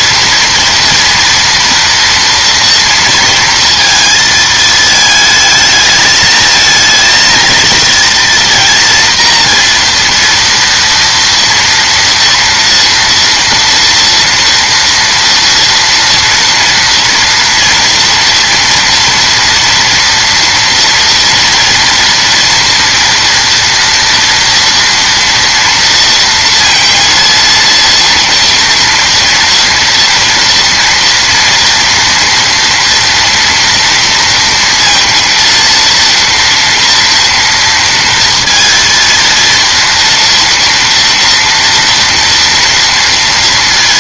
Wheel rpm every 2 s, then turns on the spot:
240, 230, 220, 230, 230, 230, 230, 230, 230, 230, 230, 240, 230, 230, 230, 230, 230, 230, 230, 230, 230, 230.
none